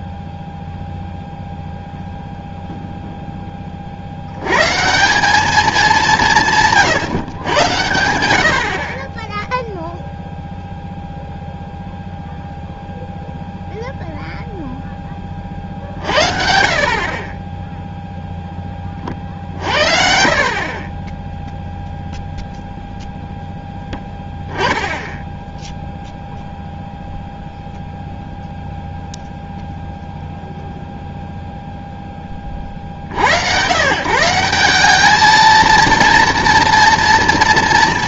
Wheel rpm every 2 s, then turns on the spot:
0, 0, 120, 160, 70, 0, 0, 0, 50, 10, 50, 0, 10, 0, 0, 0, 40, 180, 230.
none